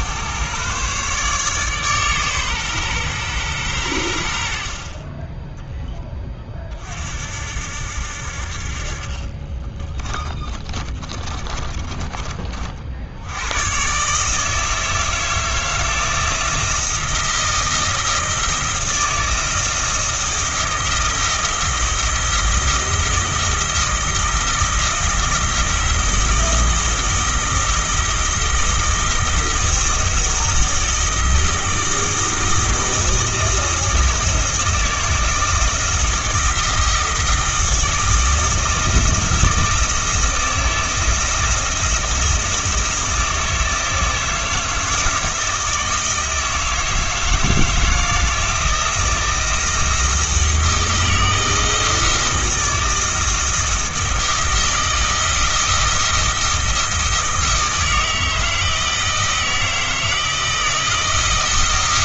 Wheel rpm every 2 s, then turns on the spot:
130, 130, 50, 40, 50, 40, 40, 160, 170, 170, 170, 170, 170, 170, 160, 160, 160, 160, 160, 160, 160, 160, 160, 160, 170, 160, 160, 170, 160, 160, 160.
10-12